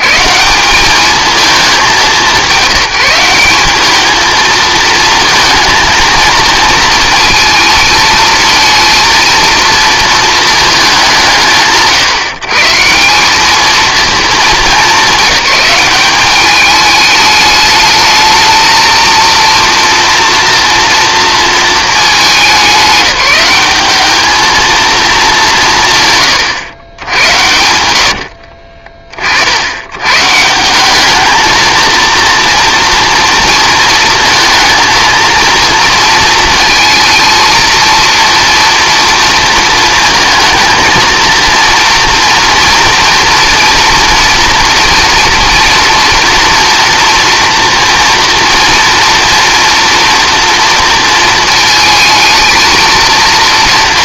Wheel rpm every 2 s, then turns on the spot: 210, 180, 230, 230, 230, 190, 180, 210, 210, 230, 230, 200, 210, 90, 30, 200, 230, 230, 230, 230, 230, 230, 230, 240, 230, 230, 230.
none